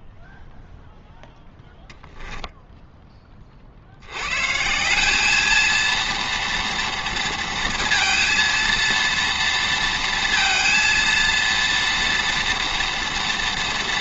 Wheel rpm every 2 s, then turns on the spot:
0, 0, 160, 230, 230, 230, 230.
none